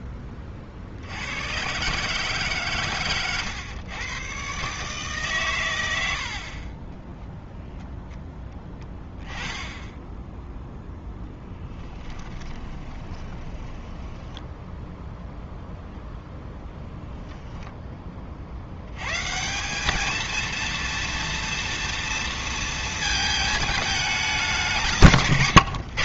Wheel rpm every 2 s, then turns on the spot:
50, 130, 140, 30, 10, 0, 20, 0, 0, 80, 230, 230, 190.
12-14